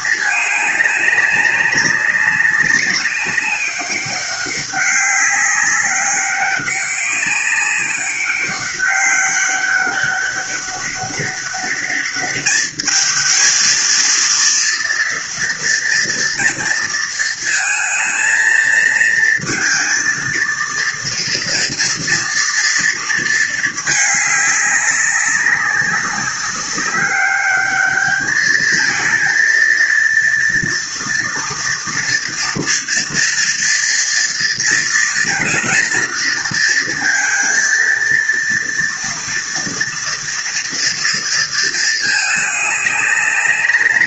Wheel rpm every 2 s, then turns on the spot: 200, 190, 200, 200, 190, 200, 220, 230, 230, 230, 230, 220, 200, 200, 230, 240, 240, 230, 230, 230, 230, 200.
none